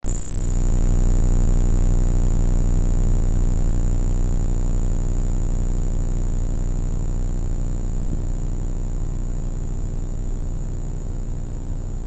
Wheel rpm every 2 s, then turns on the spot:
0, 0, 0, 0, 0, 0.
none